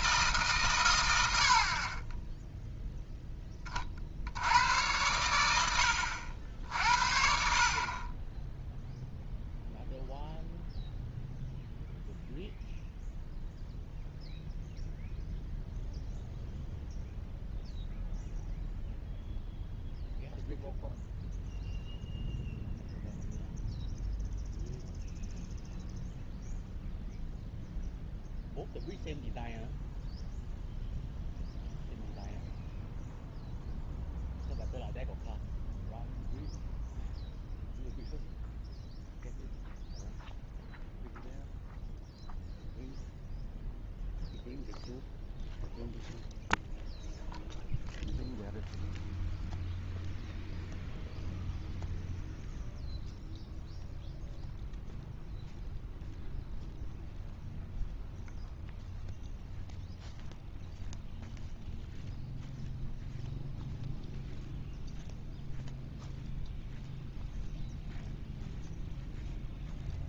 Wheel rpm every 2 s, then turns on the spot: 140, 0, 90, 70, 0, 0, 0, 0, 0, 0, 0, 0, 0, 0, 0, 0, 0, 0, 0, 0, 0, 0, 0, 0, 0, 0, 0, 0, 0, 0, 0, 0, 0, 0, 0.
none